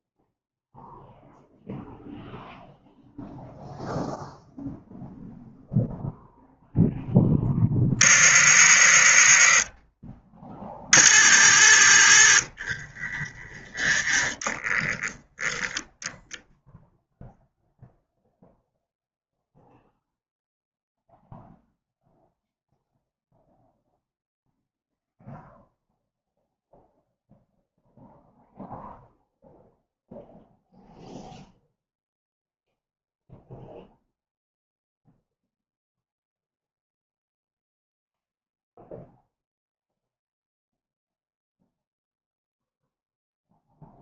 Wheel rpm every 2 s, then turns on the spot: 0, 0, 0, 0, 30, 30, 20, 10, 0, 0, 0, 0, 0, 0, 0, 0, 0, 0, 0, 0, 0, 0.
none